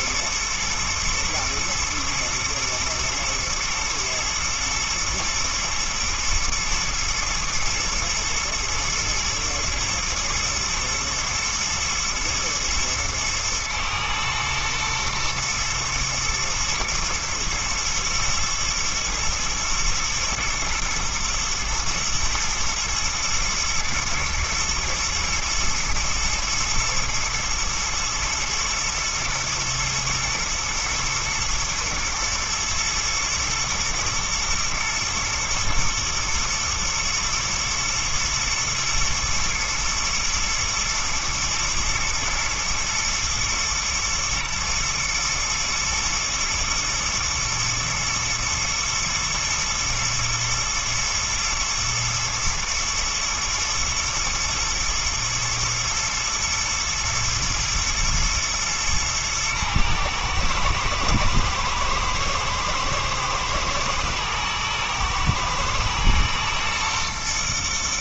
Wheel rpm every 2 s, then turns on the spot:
110, 120, 120, 110, 120, 120, 110, 120, 110, 120, 120, 110, 110, 120, 110, 110, 110, 120, 120, 110, 120, 110, 110, 110, 110, 120, 110, 120, 110, 110, 110, 110, 110, 120.
none